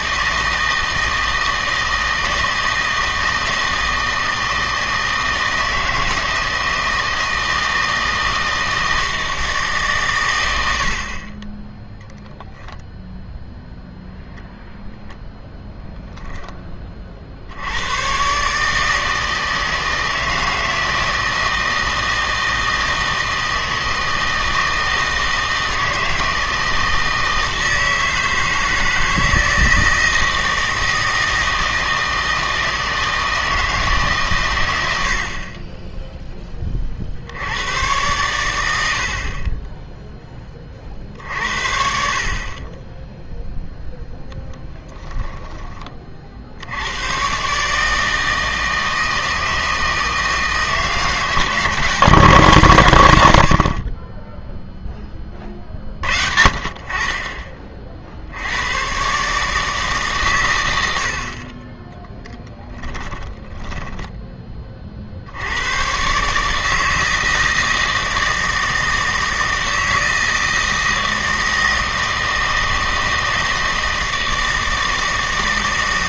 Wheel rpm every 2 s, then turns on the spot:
160, 160, 160, 160, 160, 80, 0, 0, 20, 150, 160, 160, 160, 160, 160, 160, 160, 100, 30, 100, 30, 20, 10, 80, 160, 170, 150, 0, 60, 90, 90, 10, 40, 160, 160, 160, 160, 160.
10-12 44-46 62-64